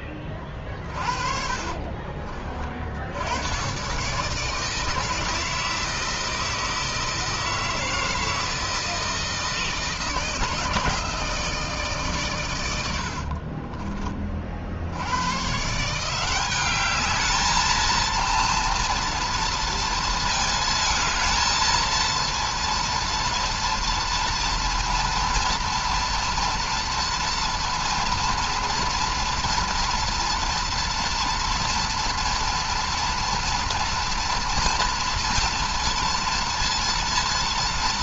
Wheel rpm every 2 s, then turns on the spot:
40, 50, 160, 160, 160, 160, 90, 80, 200, 230, 220, 230, 230, 230, 240, 230, 230, 230, 230.
0-2 12-14